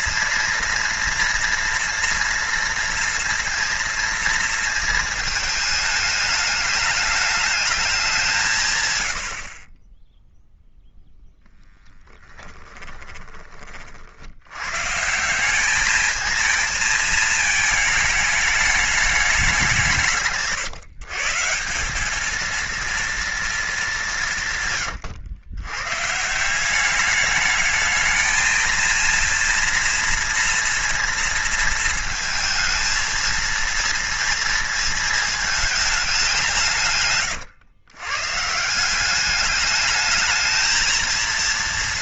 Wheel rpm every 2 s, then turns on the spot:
230, 230, 220, 210, 130, 0, 10, 130, 220, 210, 150, 230, 130, 190, 230, 230, 220, 230, 160, 170, 220.
24-26